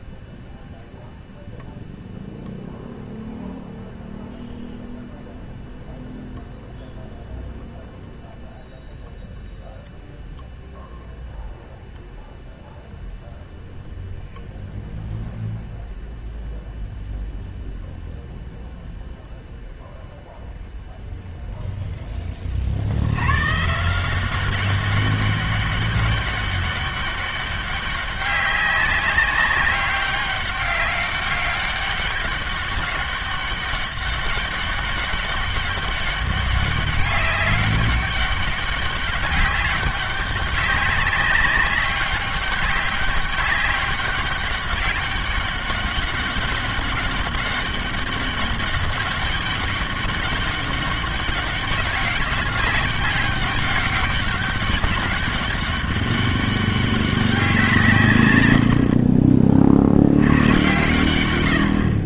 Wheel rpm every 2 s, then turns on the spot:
0, 0, 0, 0, 0, 0, 0, 0, 0, 0, 0, 60, 200, 200, 190, 200, 200, 200, 200, 200, 200, 200, 190, 200, 200, 200, 200, 200, 200, 80, 110.
none